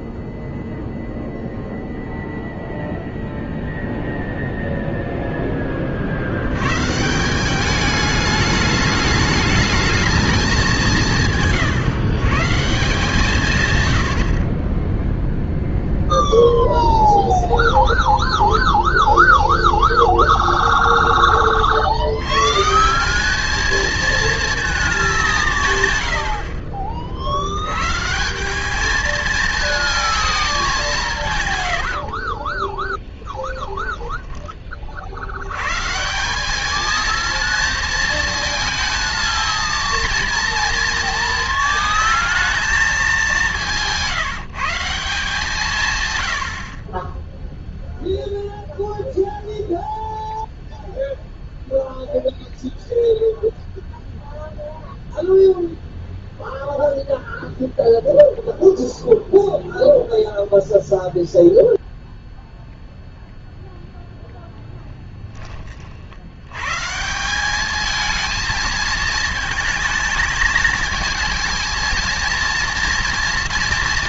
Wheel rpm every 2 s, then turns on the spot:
0, 0, 0, 130, 210, 180, 160, 10, 0, 0, 20, 180, 220, 40, 210, 190, 20, 30, 220, 220, 230, 220, 170, 40, 0, 0, 0, 0, 0, 0, 0, 0, 0, 140, 220, 220, 230.
32-34